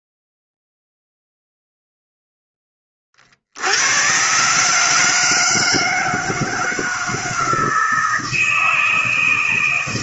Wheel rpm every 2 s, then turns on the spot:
0, 10, 140, 160, 160.
none